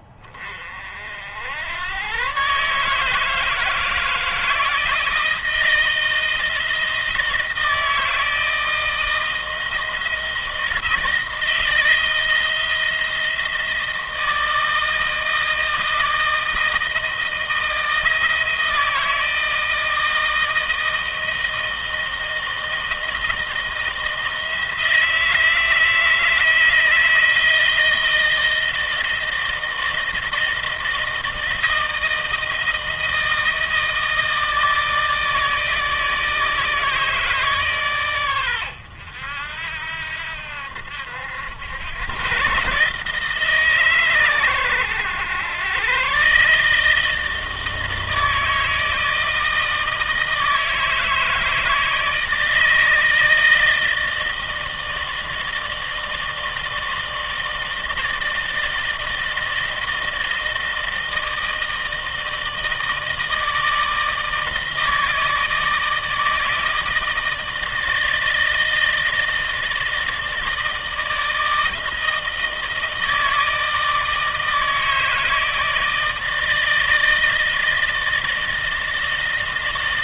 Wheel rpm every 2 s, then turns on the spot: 40, 140, 160, 160, 160, 160, 160, 160, 160, 160, 160, 160, 160, 160, 160, 160, 160, 160, 160, 90, 80, 140, 110, 150, 160, 160, 160, 160, 160, 160, 160, 160, 160, 160, 160, 160, 160, 160, 160, 160.
none